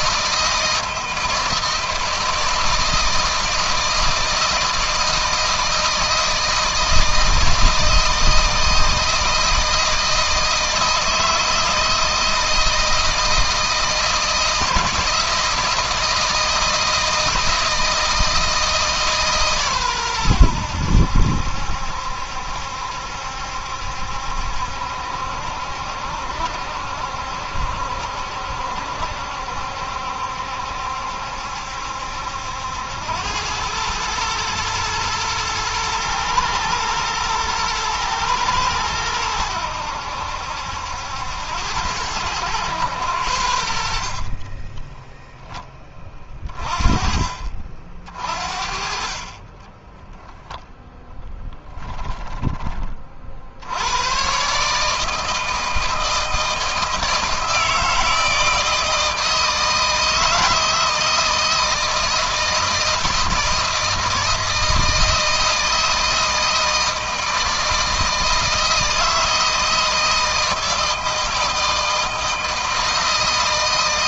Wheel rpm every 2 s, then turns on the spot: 160, 160, 160, 170, 160, 160, 160, 160, 160, 150, 80, 70, 70, 70, 70, 70, 90, 110, 120, 110, 80, 100, 20, 30, 40, 0, 30, 150, 160, 160, 160, 160, 160, 160, 160, 160, 160.
44-46